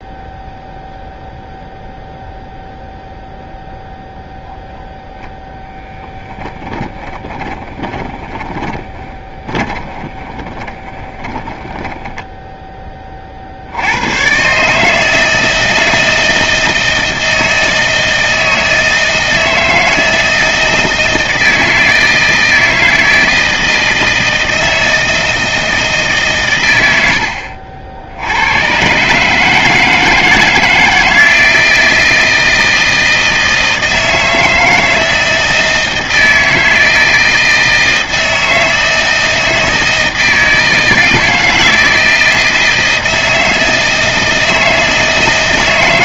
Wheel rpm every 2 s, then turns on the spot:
0, 0, 0, 10, 10, 20, 10, 110, 160, 160, 160, 160, 160, 140, 90, 160, 170, 160, 160, 160, 160, 160, 160.
6-12